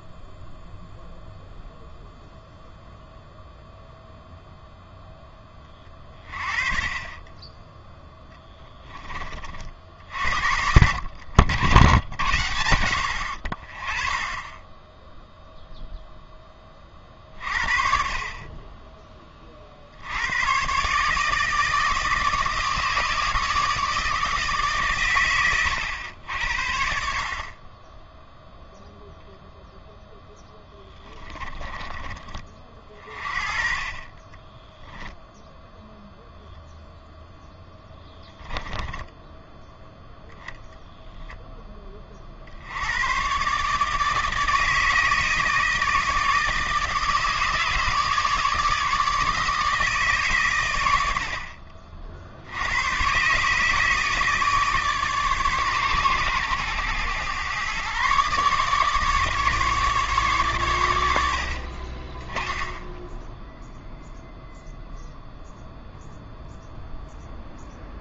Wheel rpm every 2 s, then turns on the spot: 0, 0, 0, 40, 10, 80, 80, 10, 30, 20, 120, 150, 130, 60, 0, 10, 30, 10, 0, 10, 0, 90, 160, 160, 150, 100, 90, 150, 110, 150, 120, 10, 0, 0.
30-32 38-40